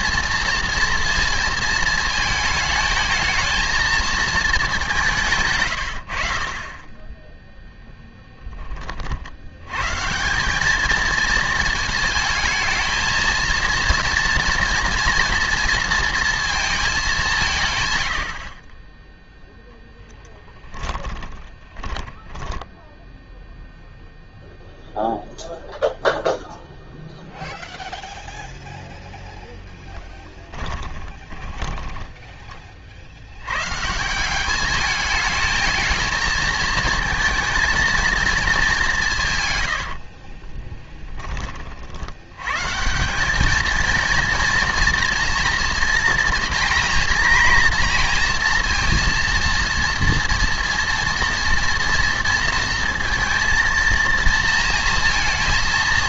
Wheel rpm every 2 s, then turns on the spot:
230, 220, 200, 20, 30, 210, 220, 240, 210, 20, 10, 10, 0, 0, 0, 20, 40, 210, 220, 190, 20, 150, 230, 240, 240, 230, 230, 230.
20-24 30-32 40-42